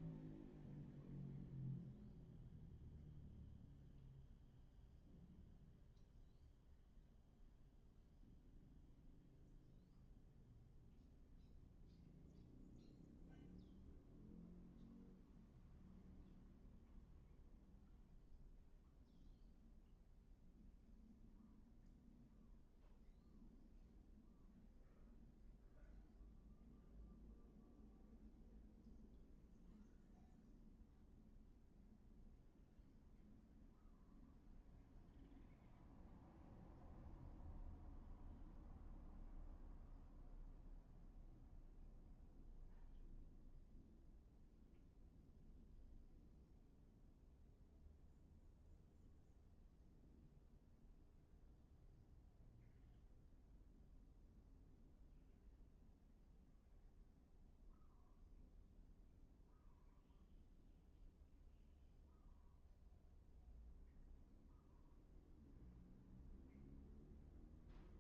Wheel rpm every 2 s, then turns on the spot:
0, 0, 0, 0, 0, 0, 0, 0, 0, 0, 0, 0, 0, 0, 0, 0, 0, 0, 0, 0, 0, 0, 0, 0, 0, 0, 0, 0, 0, 0, 0, 0, 0, 0.
none